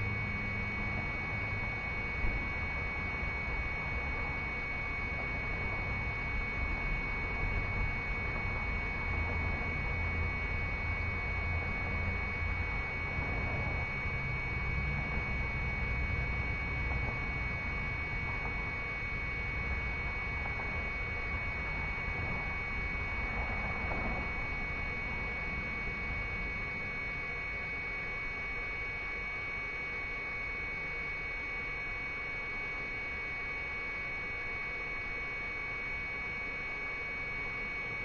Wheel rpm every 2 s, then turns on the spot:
0, 0, 0, 0, 0, 0, 0, 0, 0, 0, 0, 0, 0, 0, 0, 0, 0, 0, 0.
none